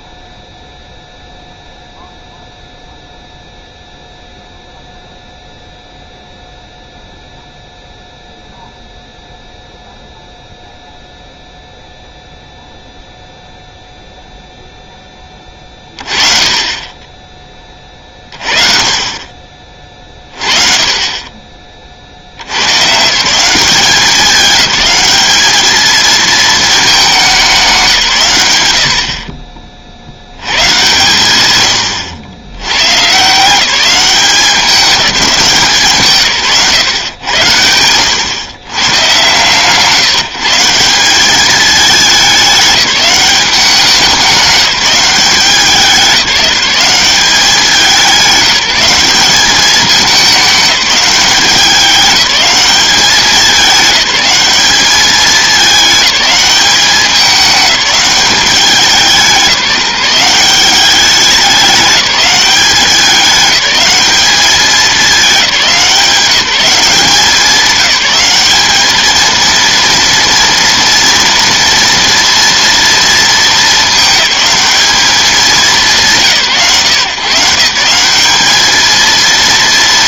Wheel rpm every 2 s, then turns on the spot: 0, 0, 0, 0, 0, 0, 0, 0, 30, 40, 40, 100, 190, 220, 100, 110, 110, 190, 120, 130, 170, 200, 190, 190, 190, 200, 200, 200, 200, 190, 190, 200, 210, 190, 210, 230, 230, 210, 150, 220.
none